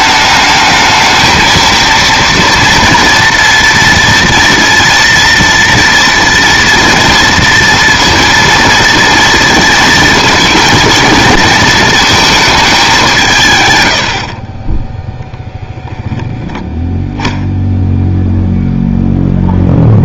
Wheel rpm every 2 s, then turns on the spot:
220, 230, 230, 230, 230, 230, 180, 10, 0, 0.
none